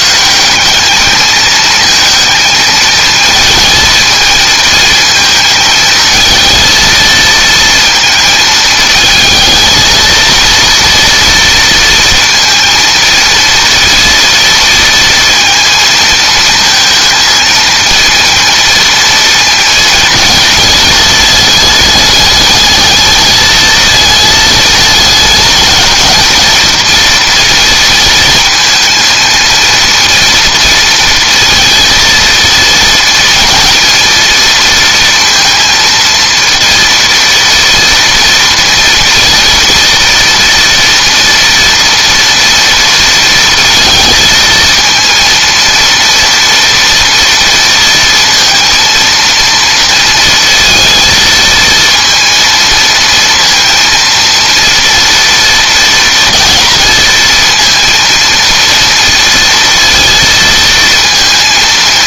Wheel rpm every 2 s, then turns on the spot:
210, 220, 220, 230, 220, 230, 230, 230, 230, 230, 220, 210, 210, 230, 230, 230, 230, 230, 230, 230, 230, 230, 230, 230, 230, 230, 230, 230, 220, 230, 230.
none